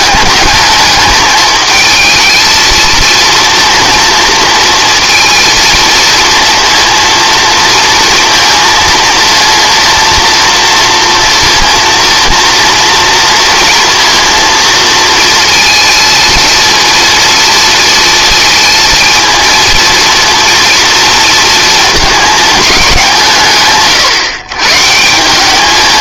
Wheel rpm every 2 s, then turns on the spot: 220, 230, 230, 230, 230, 240, 240, 230, 230, 230, 230, 220, 140.
none